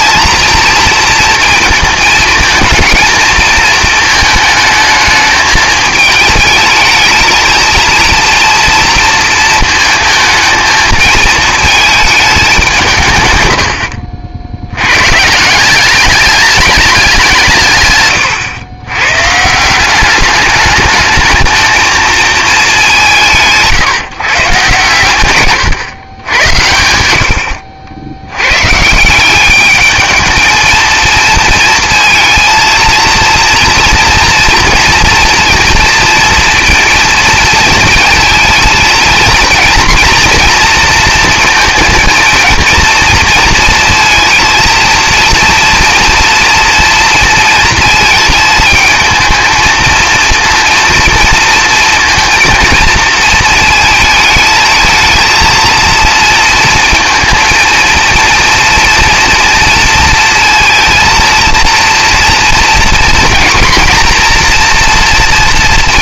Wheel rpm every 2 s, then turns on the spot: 220, 220, 220, 210, 230, 220, 190, 70, 210, 110, 200, 210, 130, 90, 120, 220, 230, 230, 230, 230, 240, 230, 230, 230, 220, 230, 230, 220, 230, 230, 230, 230, 240.
none